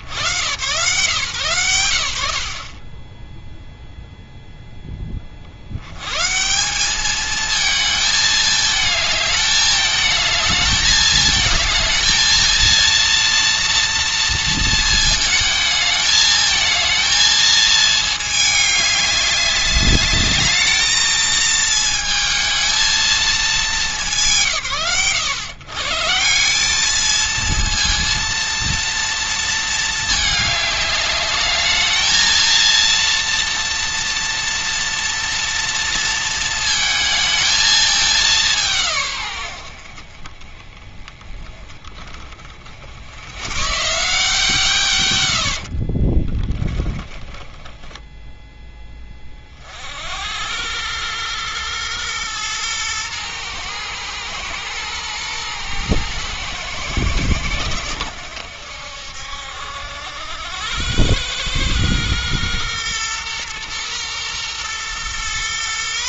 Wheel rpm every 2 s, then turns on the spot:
120, 20, 10, 200, 220, 220, 230, 230, 220, 210, 220, 220, 100, 210, 230, 210, 230, 230, 220, 130, 20, 70, 150, 20, 20, 110, 120, 110, 110, 70, 100, 120, 120.
46-48